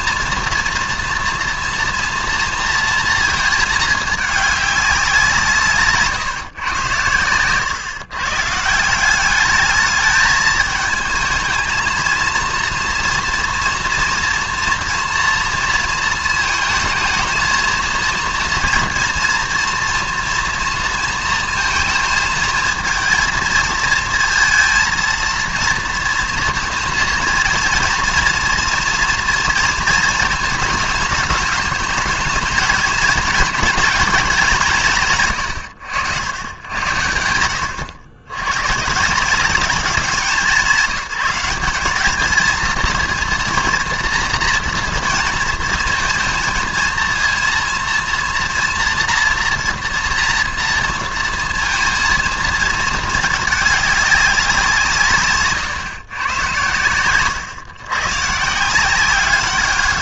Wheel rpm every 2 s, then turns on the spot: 230, 230, 210, 130, 150, 220, 230, 230, 220, 230, 230, 230, 220, 230, 240, 220, 220, 210, 90, 110, 180, 220, 230, 230, 240, 230, 230, 180, 120, 160.
none